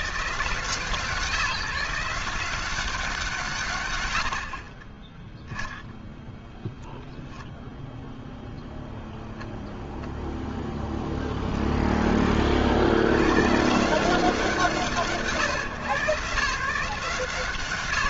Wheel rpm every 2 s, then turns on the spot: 160, 60, 0, 0, 0, 50, 150, 150, 170.
2-4